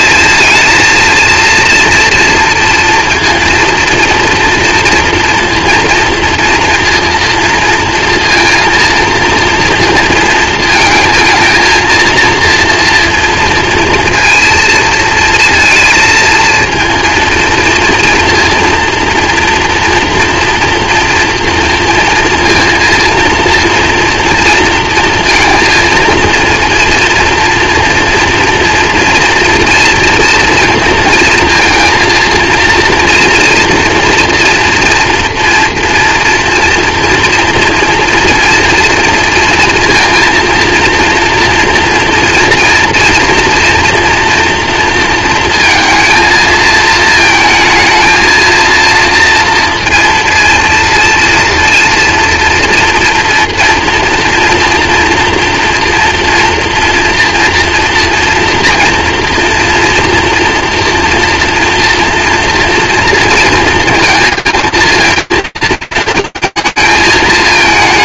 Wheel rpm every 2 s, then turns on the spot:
220, 230, 230, 230, 230, 230, 240, 230, 230, 230, 240, 230, 230, 230, 240, 240, 230, 230, 230, 230, 230, 230, 230, 230, 230, 230, 230, 230, 230, 230, 230, 230, 230, 230.
none